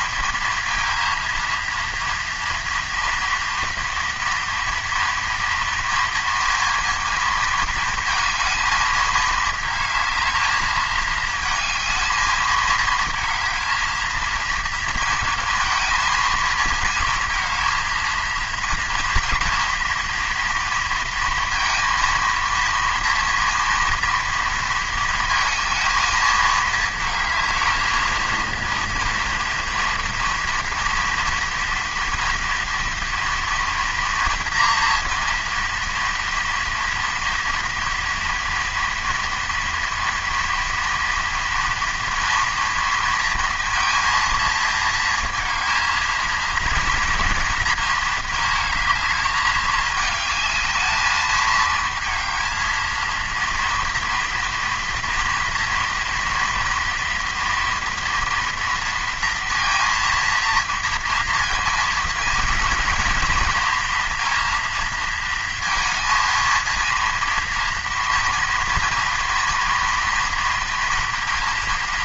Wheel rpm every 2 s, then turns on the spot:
230, 230, 230, 230, 220, 210, 220, 230, 230, 230, 230, 230, 230, 220, 230, 230, 230, 230, 230, 230, 230, 230, 230, 230, 220, 220, 220, 230, 230, 230, 230, 240, 240, 230, 230, 230.
none